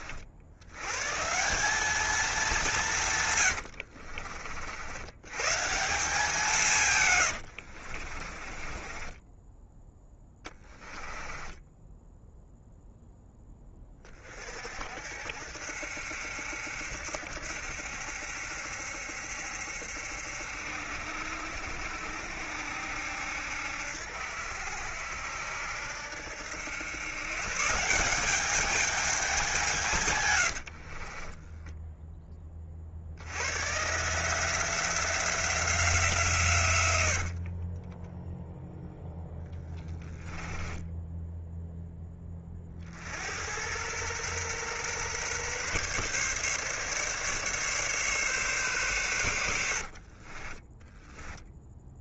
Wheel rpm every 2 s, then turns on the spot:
120, 160, 80, 140, 20, 10, 0, 60, 70, 70, 70, 70, 70, 100, 210, 50, 40, 170, 100, 0, 10, 60, 130, 140, 130, 20.
6-12 30-32 36-38 40-42 50-52